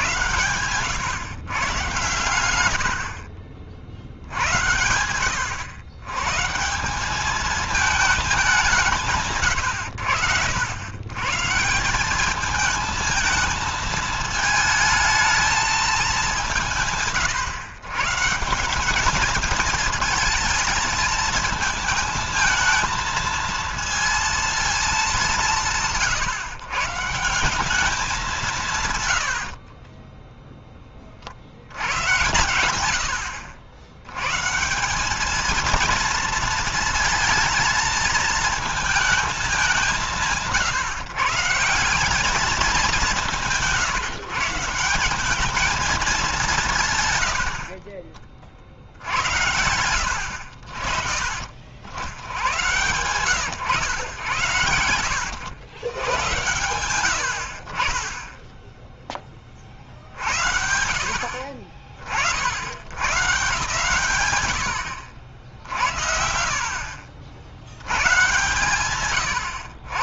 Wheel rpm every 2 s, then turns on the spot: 100, 100, 80, 150, 200, 100, 210, 220, 170, 180, 220, 220, 230, 140, 170, 10, 110, 150, 230, 220, 150, 210, 170, 160, 40, 70, 90, 90, 100, 10, 70, 80, 120, 60, 120.
66-68